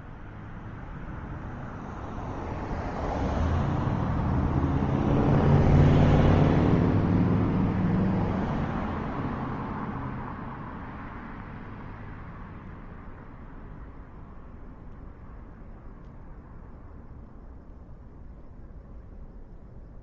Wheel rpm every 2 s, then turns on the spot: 0, 0, 0, 0, 0, 0, 0, 0, 0, 0.
none